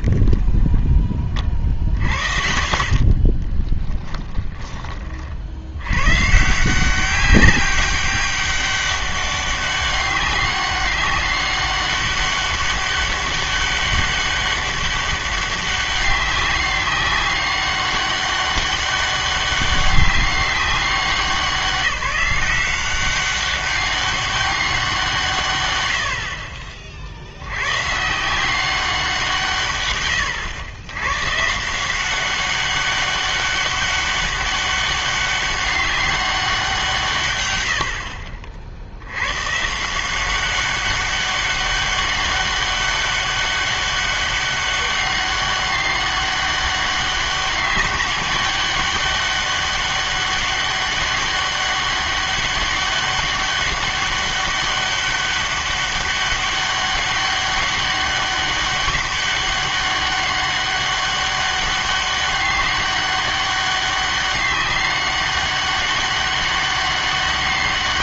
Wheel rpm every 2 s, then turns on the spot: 0, 50, 20, 150, 200, 190, 200, 200, 200, 200, 190, 180, 200, 40, 180, 100, 190, 200, 180, 50, 190, 200, 200, 200, 200, 200, 200, 200, 200, 190, 200, 200, 200, 200.
2-6